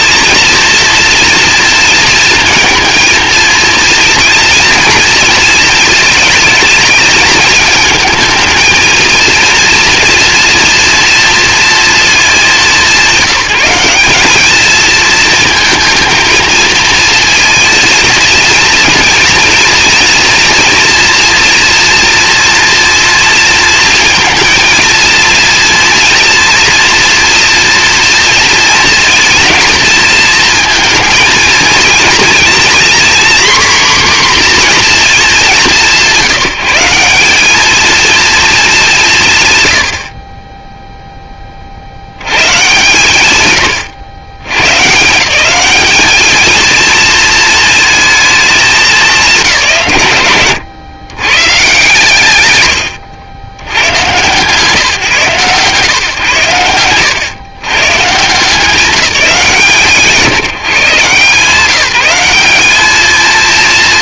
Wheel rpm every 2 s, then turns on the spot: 230, 230, 230, 220, 220, 230, 180, 220, 230, 230, 230, 230, 230, 240, 230, 220, 240, 250, 190, 200, 10, 110, 130, 220, 210, 130, 110, 150, 100, 180, 160, 210.
50-52